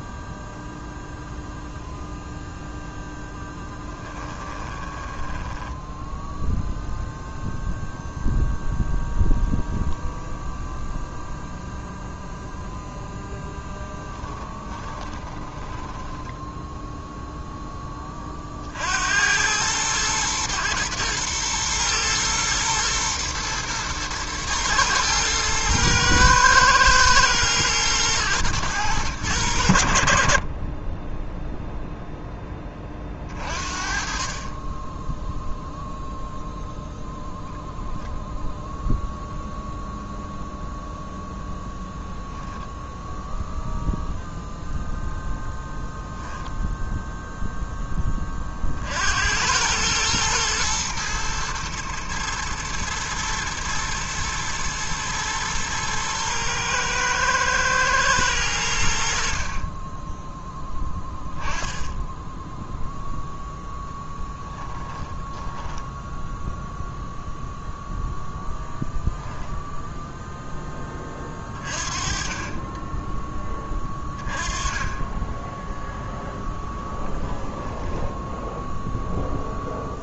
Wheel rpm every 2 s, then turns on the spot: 0, 0, 20, 0, 0, 0, 0, 20, 0, 80, 110, 110, 110, 110, 110, 10, 30, 10, 0, 0, 0, 0, 0, 0, 60, 110, 120, 110, 110, 70, 10, 0, 20, 0, 0, 20, 10, 20, 10, 0.
4-6 14-16 64-66 76-78